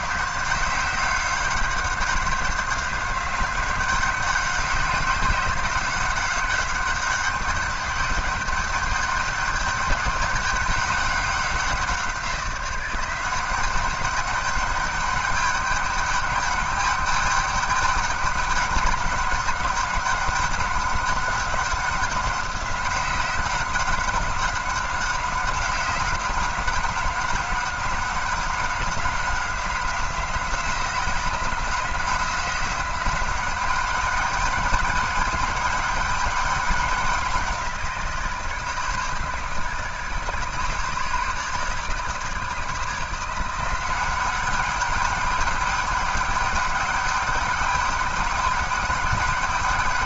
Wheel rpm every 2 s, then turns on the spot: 190, 190, 190, 190, 200, 200, 180, 200, 200, 200, 200, 190, 190, 190, 190, 180, 190, 210, 190, 150, 150, 160, 200, 200, 200.
none